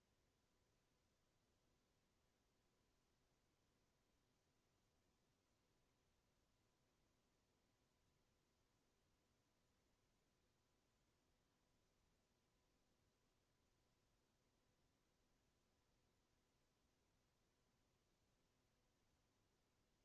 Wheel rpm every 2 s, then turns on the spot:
0, 0, 0, 0, 0, 0, 0, 0, 0, 0.
none